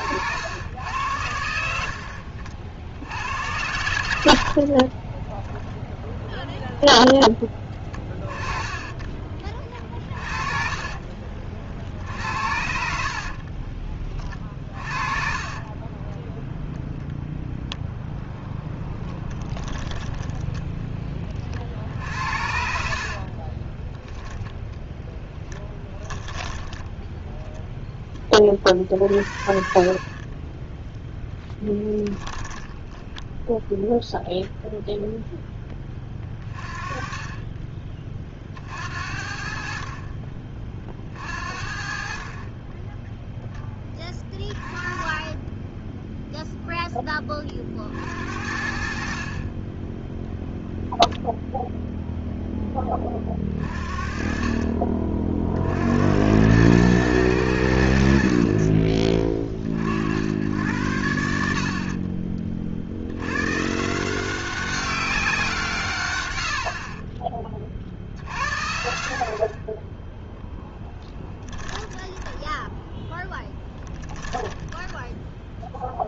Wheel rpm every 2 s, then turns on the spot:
90, 60, 60, 0, 20, 40, 50, 30, 0, 10, 10, 70, 0, 10, 40, 10, 20, 0, 30, 50, 40, 30, 20, 0, 60, 0, 10, 30, 100, 50, 80, 50, 190, 70, 70, 20, 10, 10.
4-6 10-12 14-16 32-34 48-50 72-76